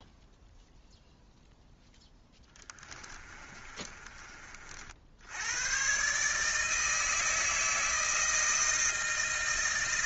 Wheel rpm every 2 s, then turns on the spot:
0, 20, 60, 160, 160.
2-4